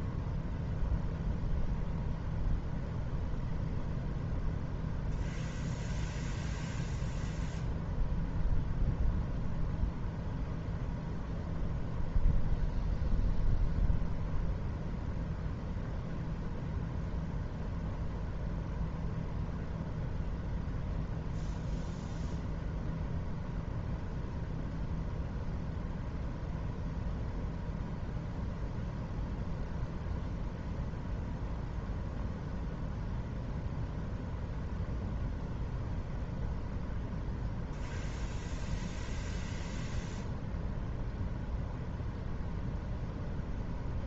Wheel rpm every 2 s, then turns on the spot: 0, 0, 0, 0, 0, 0, 0, 0, 0, 0, 0, 0, 0, 0, 0, 0, 0, 0, 0, 0, 0, 0.
none